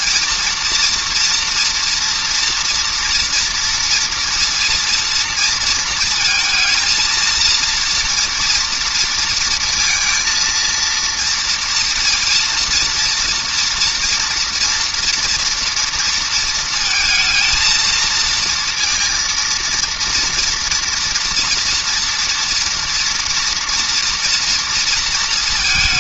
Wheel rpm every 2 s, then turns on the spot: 230, 230, 230, 220, 230, 230, 230, 230, 230, 220, 230, 240, 230.
none